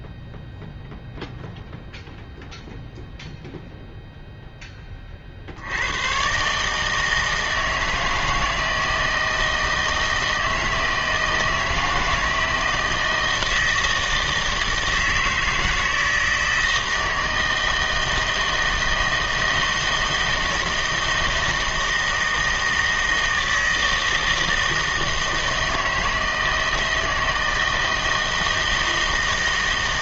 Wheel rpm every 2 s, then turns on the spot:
0, 0, 10, 140, 160, 160, 160, 160, 160, 160, 160, 160, 160, 160, 160.
none